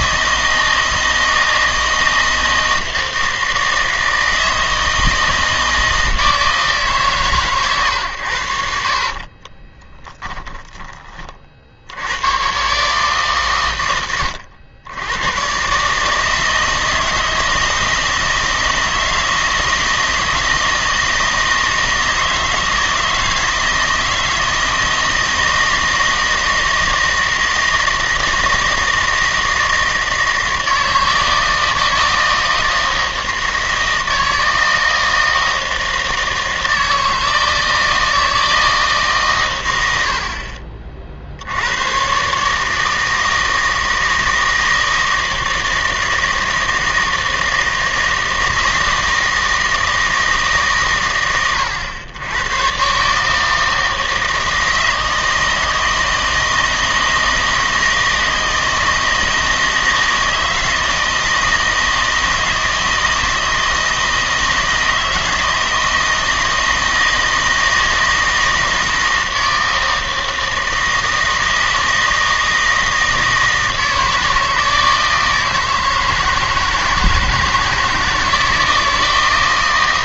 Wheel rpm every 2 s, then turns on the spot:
160, 160, 160, 150, 60, 30, 130, 90, 160, 160, 160, 160, 160, 160, 160, 160, 160, 160, 160, 160, 50, 150, 160, 160, 160, 140, 120, 160, 160, 160, 160, 160, 160, 160, 160, 160, 160, 160, 160, 160.
8-12